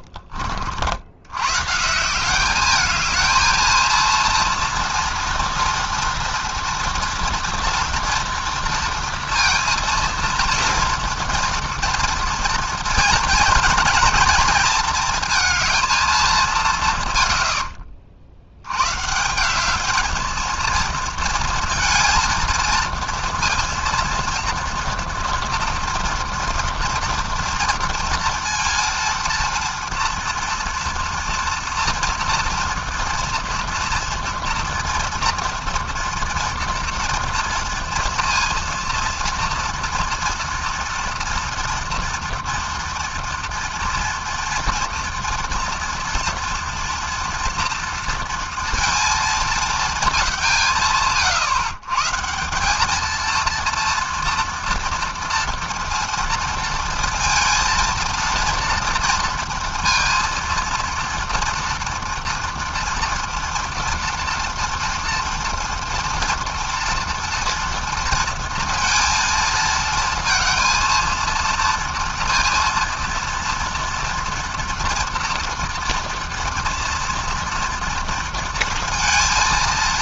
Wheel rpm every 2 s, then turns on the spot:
100, 220, 240, 230, 230, 230, 220, 230, 120, 160, 220, 230, 230, 230, 230, 230, 230, 230, 230, 230, 230, 230, 230, 230, 230, 140, 220, 230, 230, 230, 230, 230, 230, 230, 230, 230, 230, 230, 230, 230.
16-18